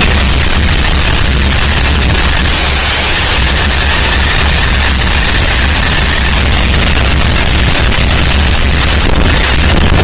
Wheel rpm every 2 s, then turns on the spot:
100, 230, 230, 210, 140.
none